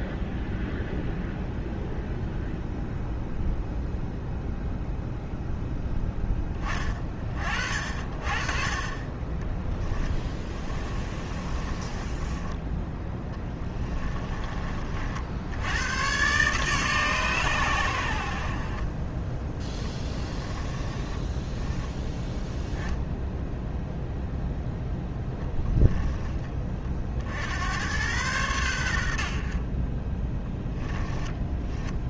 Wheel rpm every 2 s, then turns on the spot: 0, 0, 0, 20, 30, 20, 20, 50, 140, 40, 20, 10, 0, 40, 90, 10.
10-12 20-22 30-32